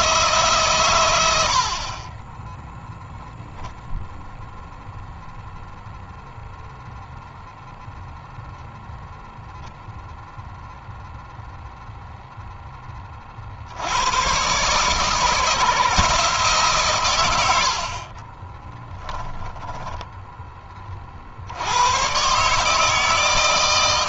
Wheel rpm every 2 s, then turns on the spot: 130, 10, 0, 0, 0, 0, 20, 140, 140, 20, 20, 150.
18-20